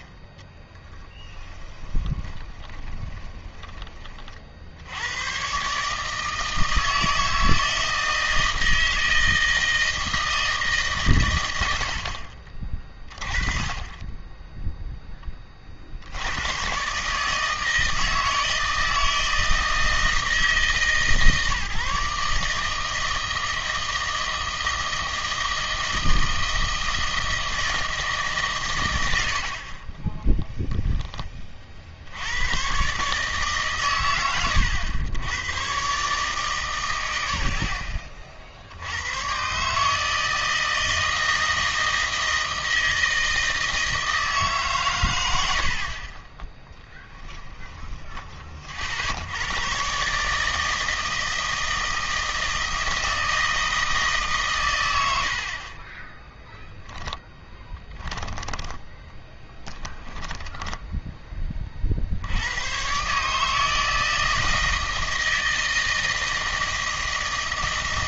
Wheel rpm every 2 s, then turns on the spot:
10, 20, 70, 160, 160, 160, 40, 0, 130, 160, 160, 150, 160, 160, 140, 10, 120, 90, 140, 70, 160, 160, 130, 10, 40, 160, 170, 120, 10, 10, 10, 110, 160, 160.
0-4 30-32 46-48 58-62